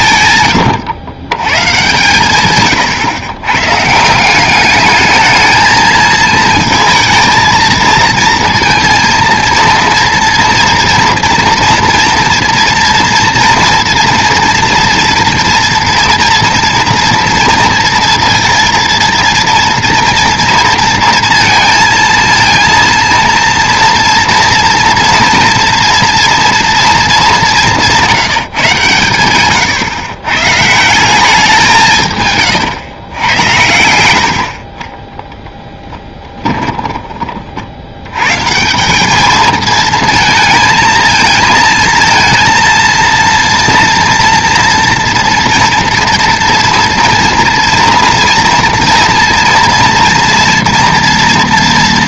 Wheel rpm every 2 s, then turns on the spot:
110, 130, 200, 220, 230, 230, 240, 230, 240, 230, 230, 230, 230, 230, 150, 140, 130, 50, 10, 150, 220, 230, 230, 230, 230, 230.
0-2